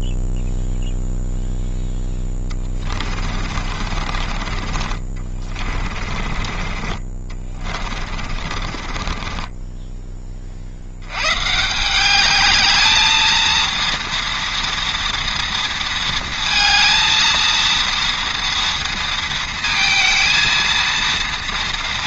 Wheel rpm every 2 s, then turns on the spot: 0, 30, 40, 40, 30, 80, 220, 230, 230, 230, 230.
2-4 8-10